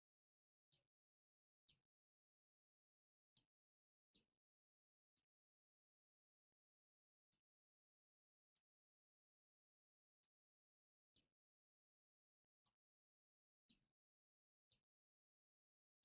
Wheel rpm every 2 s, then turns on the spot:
0, 0, 0, 0, 0, 0, 0, 0.
none